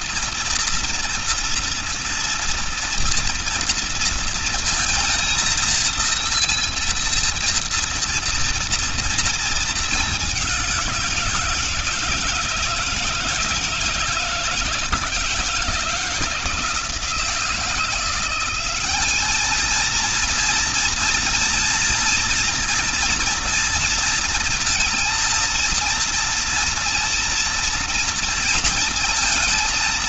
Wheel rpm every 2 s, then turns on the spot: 230, 230, 220, 230, 230, 190, 160, 160, 160, 190, 230, 230, 220, 230, 230.
none